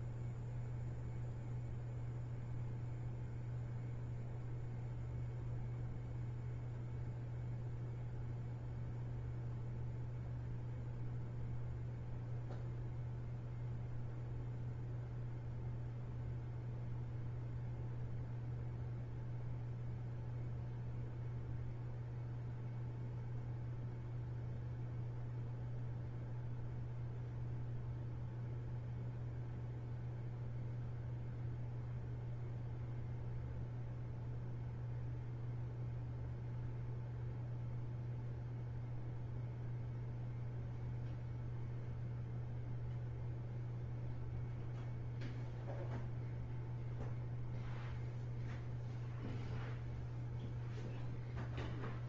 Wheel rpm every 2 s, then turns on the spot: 0, 0, 0, 0, 0, 0, 0, 0, 0, 0, 0, 0, 0, 0, 0, 0, 0, 0, 0, 0, 0, 0, 0, 0, 0, 0.
none